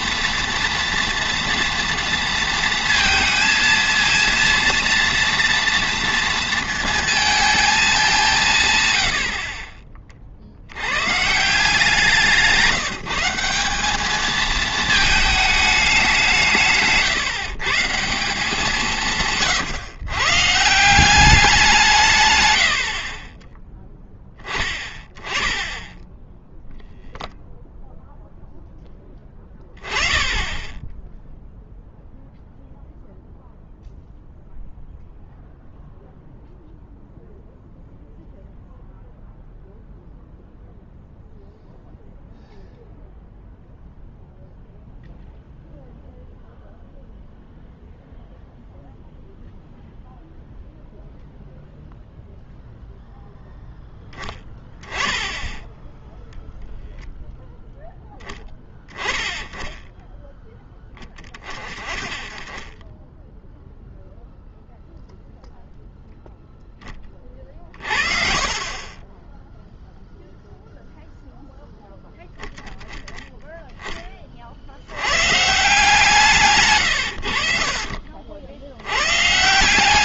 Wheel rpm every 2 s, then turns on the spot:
240, 230, 240, 230, 140, 90, 160, 220, 150, 170, 160, 80, 10, 0, 10, 10, 0, 0, 0, 0, 0, 0, 0, 0, 0, 0, 0, 20, 0, 10, 10, 20, 0, 10, 40, 0, 0, 70, 130, 80.
68-70 76-78